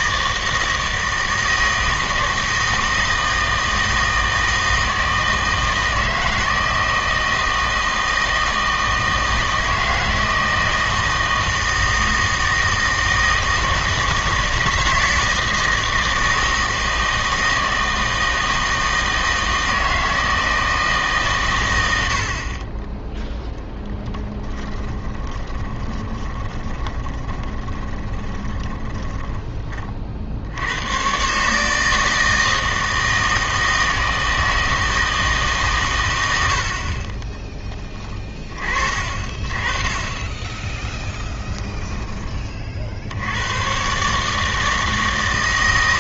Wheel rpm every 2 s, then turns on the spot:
160, 160, 160, 160, 160, 160, 160, 160, 160, 160, 160, 30, 10, 20, 20, 90, 160, 160, 50, 40, 10, 50, 160.
24-30